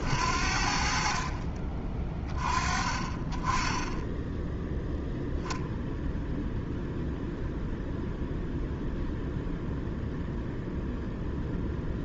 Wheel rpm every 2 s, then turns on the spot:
50, 20, 0, 0, 0, 0.
none